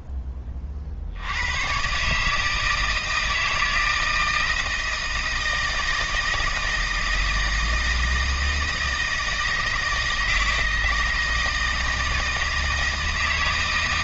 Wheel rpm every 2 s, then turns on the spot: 30, 160, 160, 160, 160, 160, 160.
none